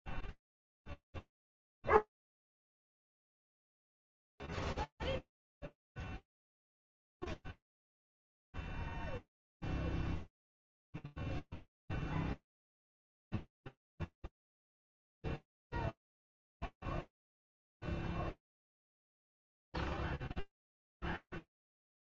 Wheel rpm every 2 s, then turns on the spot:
0, 0, 0, 0, 0, 0, 0, 0, 0, 0, 0.
none